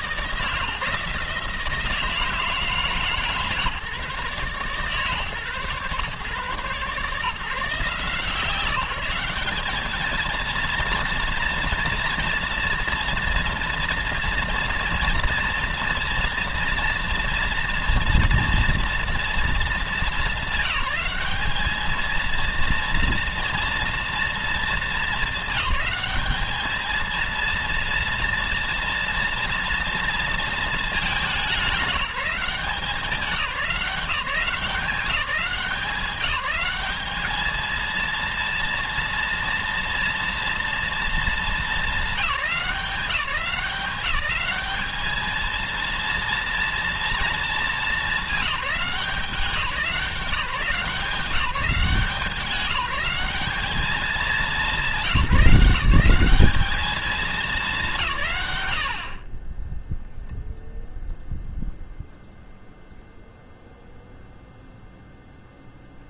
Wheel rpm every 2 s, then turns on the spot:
160, 160, 140, 140, 170, 230, 230, 230, 230, 230, 210, 230, 220, 220, 230, 220, 190, 190, 200, 230, 220, 160, 200, 230, 180, 190, 190, 200, 210, 100, 0, 0, 0.
58-60